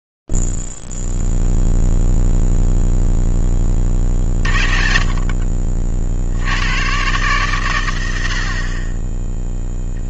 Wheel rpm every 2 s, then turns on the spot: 0, 0, 20, 50, 100.
none